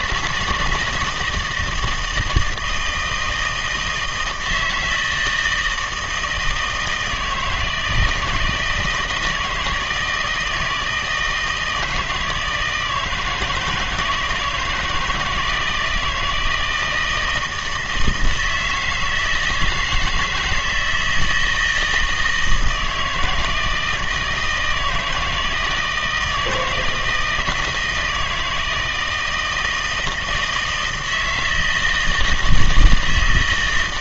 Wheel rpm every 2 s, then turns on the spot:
160, 160, 160, 160, 170, 160, 160, 160, 160, 160, 160, 160, 160, 160, 160, 160, 160.
none